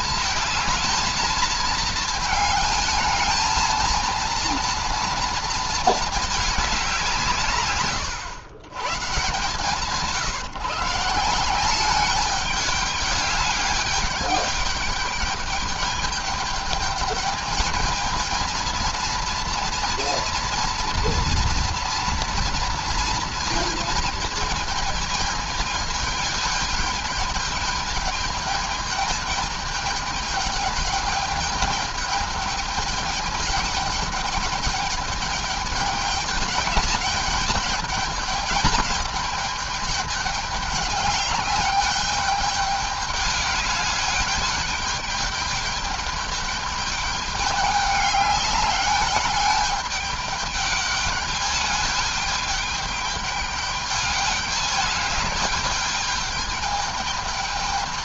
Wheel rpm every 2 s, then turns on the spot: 220, 220, 230, 210, 120, 160, 210, 210, 210, 220, 230, 230, 220, 210, 210, 210, 210, 210, 210, 210, 210, 210, 210, 210, 200, 210, 210, 210, 210.
none